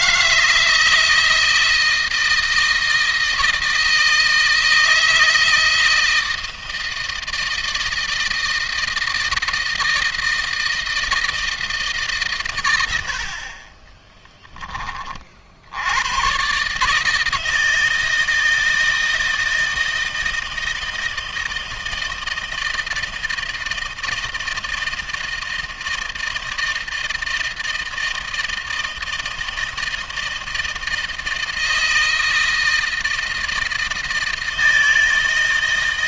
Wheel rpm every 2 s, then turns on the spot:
160, 160, 160, 160, 160, 160, 90, 30, 150, 160, 160, 160, 160, 160, 160, 160, 160, 160.
none